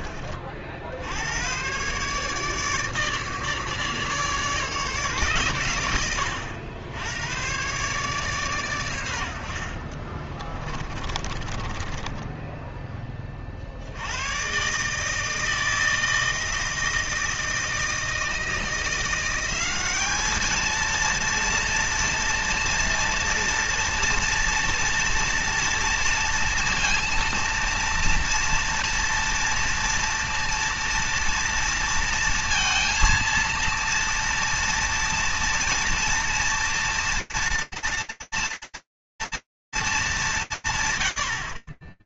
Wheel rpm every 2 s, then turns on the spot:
80, 150, 140, 100, 90, 30, 20, 150, 160, 170, 230, 230, 230, 230, 230, 230, 230, 230, 230, 230, 160.
10-12